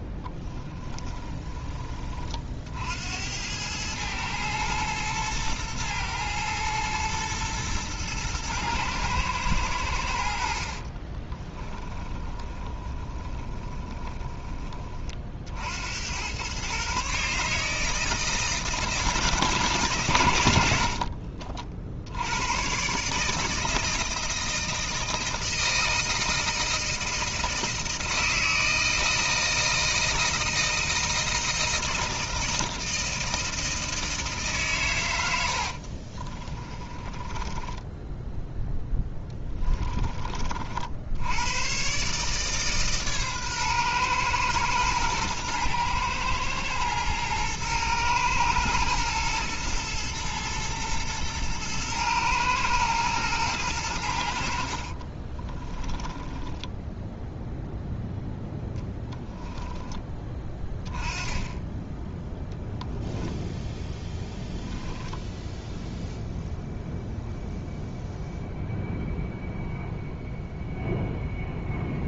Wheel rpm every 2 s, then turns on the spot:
20, 60, 110, 110, 110, 60, 20, 30, 130, 160, 70, 120, 160, 160, 160, 160, 160, 130, 20, 10, 60, 150, 110, 110, 110, 110, 110, 50, 0, 0, 20, 0, 0, 0, 0, 0.
0-2 10-14 36-40 54-56